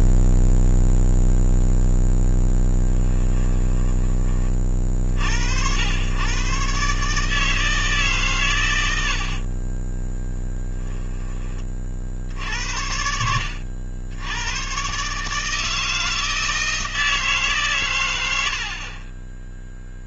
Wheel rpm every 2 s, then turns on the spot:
0, 10, 30, 130, 110, 0, 70, 110, 160, 60.
2-4 8-10 12-14